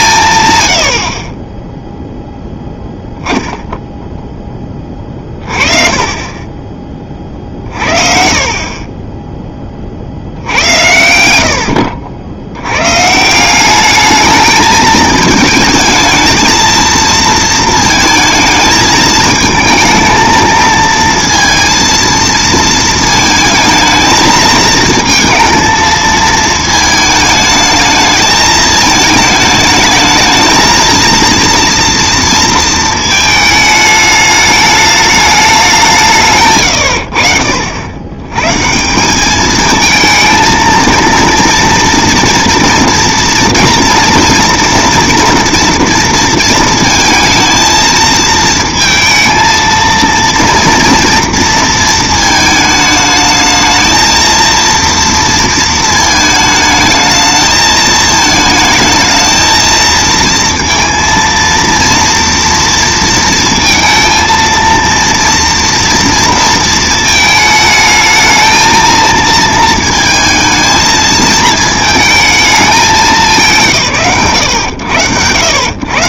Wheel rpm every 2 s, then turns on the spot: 120, 0, 10, 30, 40, 60, 90, 210, 220, 220, 220, 230, 220, 220, 220, 220, 230, 210, 150, 130, 230, 230, 230, 230, 220, 230, 220, 230, 220, 220, 230, 230, 230, 230, 220, 230, 220, 110.
8-10